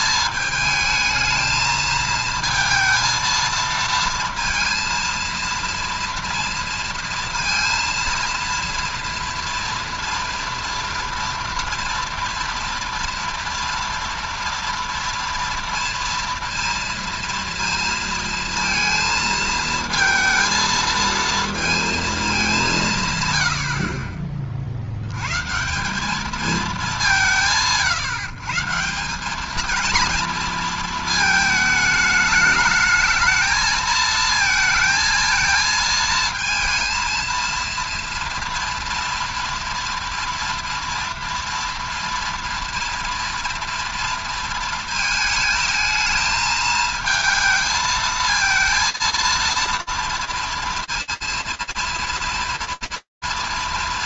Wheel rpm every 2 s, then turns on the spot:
220, 230, 230, 230, 230, 230, 230, 230, 230, 230, 230, 200, 50, 200, 150, 230, 210, 220, 230, 230, 230, 230, 230, 220, 230, 230, 230.
none